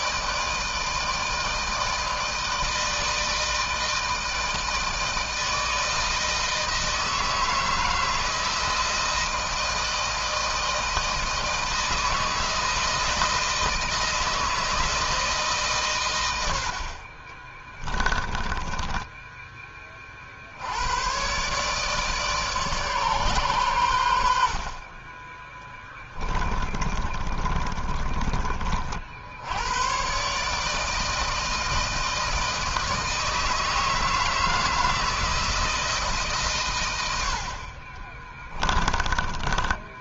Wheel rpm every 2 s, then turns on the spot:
160, 160, 160, 160, 160, 160, 160, 160, 50, 10, 110, 140, 30, 30, 60, 160, 160, 160, 80, 20.
16-20 26-28 38-40